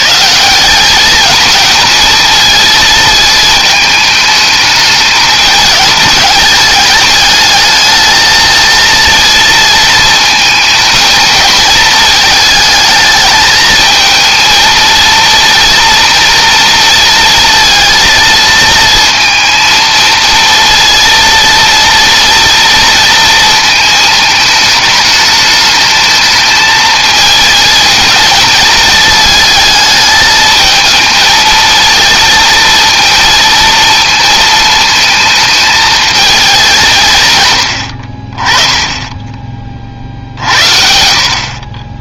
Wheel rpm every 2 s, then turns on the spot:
200, 220, 210, 210, 230, 220, 220, 230, 230, 230, 230, 230, 210, 220, 220, 220, 230, 220, 160, 10, 60.
none